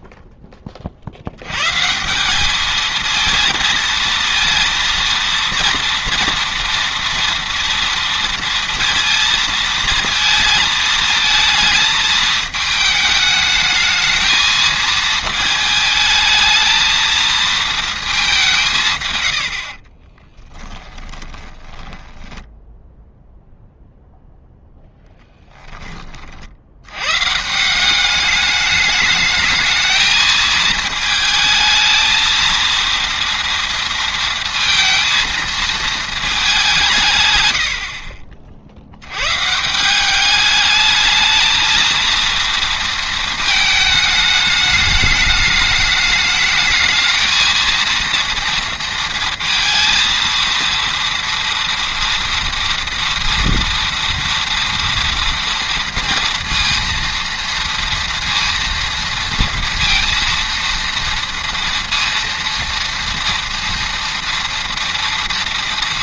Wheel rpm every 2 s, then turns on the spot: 20, 210, 230, 240, 230, 230, 220, 220, 220, 170, 10, 10, 0, 70, 210, 220, 230, 230, 190, 70, 210, 230, 210, 220, 230, 230, 230, 230, 230, 230, 230, 230, 230.
20-24